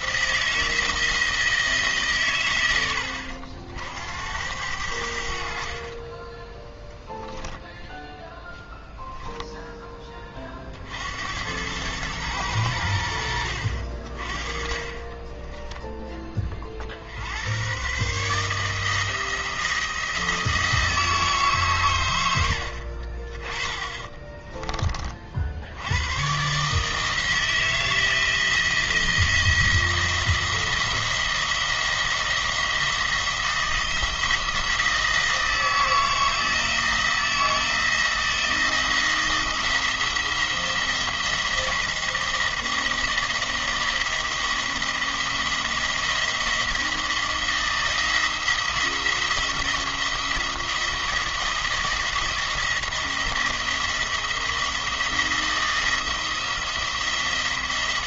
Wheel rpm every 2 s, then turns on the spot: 160, 100, 90, 10, 0, 40, 100, 30, 40, 150, 160, 70, 20, 150, 170, 170, 170, 160, 160, 170, 170, 170, 170, 160, 170, 170, 160, 170, 170.
6-8